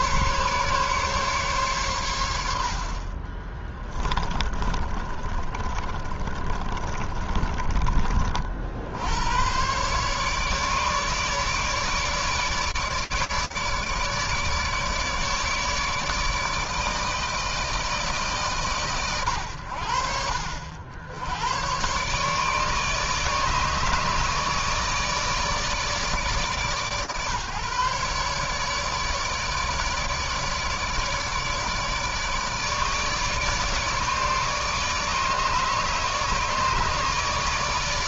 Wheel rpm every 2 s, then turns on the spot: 130, 20, 30, 30, 110, 150, 150, 150, 160, 100, 110, 150, 150, 140, 150, 150, 150, 150, 160.
2-8